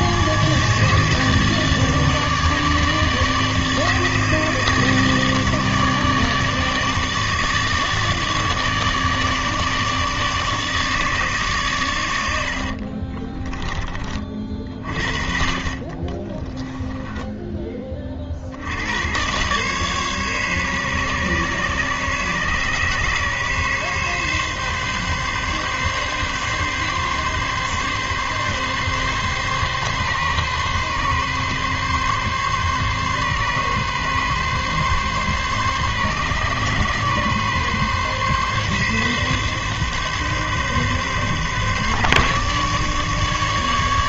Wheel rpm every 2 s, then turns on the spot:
150, 150, 150, 150, 160, 150, 70, 40, 10, 70, 140, 140, 140, 140, 140, 140, 140, 130, 140, 140, 140, 140.
12-14 16-18